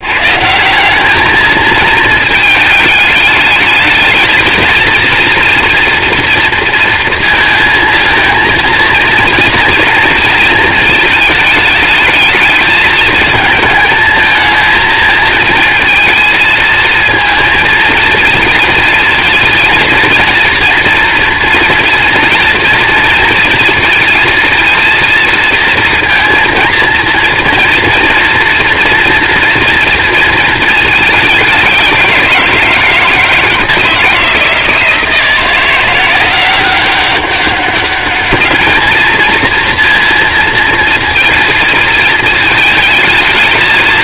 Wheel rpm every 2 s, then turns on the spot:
180, 220, 230, 230, 230, 230, 220, 220, 220, 230, 230, 230, 230, 230, 230, 220, 170, 160, 190, 220, 230, 220.
none